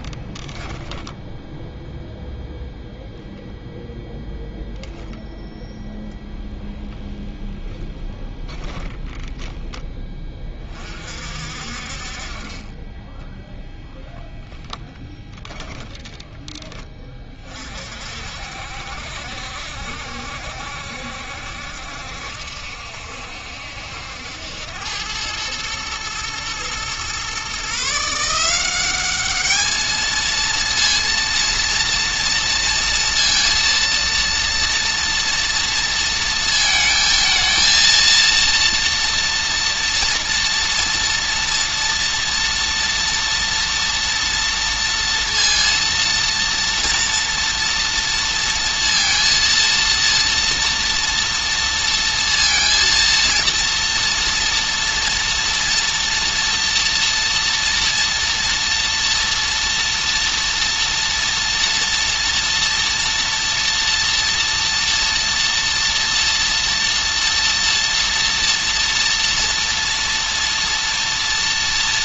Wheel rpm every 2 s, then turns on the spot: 10, 0, 10, 0, 20, 40, 10, 10, 20, 70, 70, 70, 90, 120, 190, 230, 230, 230, 220, 230, 230, 230, 230, 230, 230, 230, 230, 230, 240, 240, 230, 230, 230, 230, 230, 230.
0-2 14-16